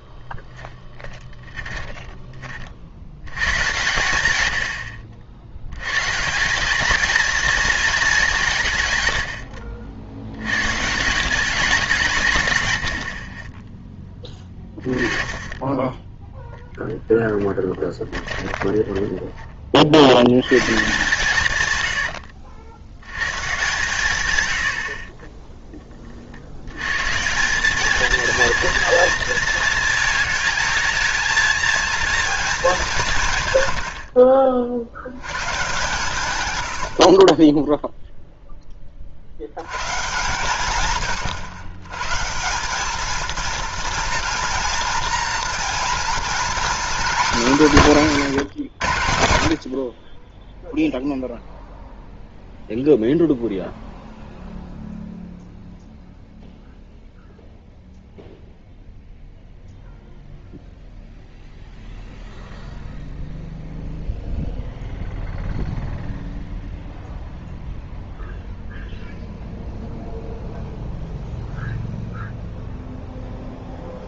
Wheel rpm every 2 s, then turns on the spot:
10, 50, 90, 210, 140, 130, 100, 20, 0, 20, 130, 70, 90, 100, 230, 220, 210, 60, 80, 20, 120, 200, 240, 260, 160, 0, 0, 0, 0, 0, 0, 0, 0, 0, 0, 0, 0.
0-2 18-20